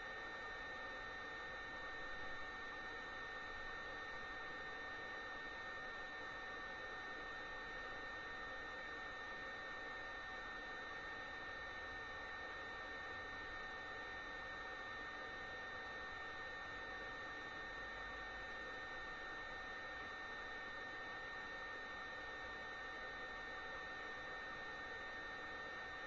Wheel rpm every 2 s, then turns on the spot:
0, 0, 0, 0, 0, 0, 0, 0, 0, 0, 0, 0, 0.
none